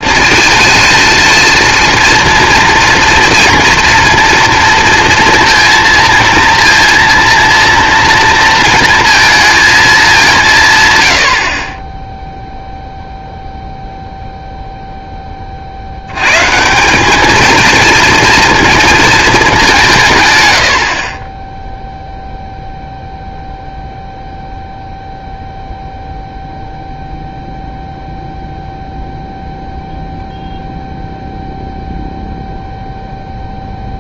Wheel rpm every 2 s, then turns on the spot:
230, 230, 230, 230, 230, 190, 0, 10, 190, 220, 40, 0, 0, 0, 0, 0, 0.
none